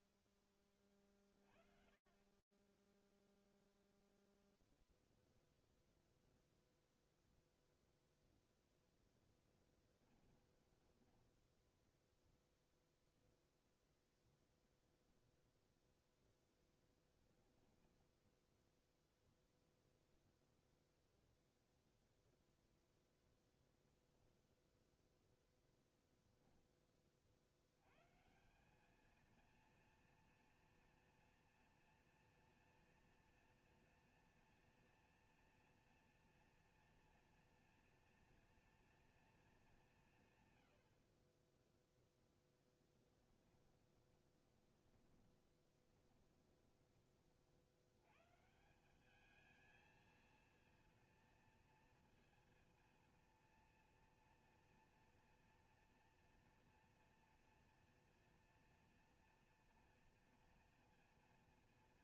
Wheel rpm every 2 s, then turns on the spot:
0, 0, 0, 10, 10, 0, 0, 10, 0, 0, 0, 0, 30, 220, 240, 240, 230, 230, 230, 40, 10, 20, 20, 190, 230, 230, 230, 240, 240, 230, 230.
8-10 14-16 40-44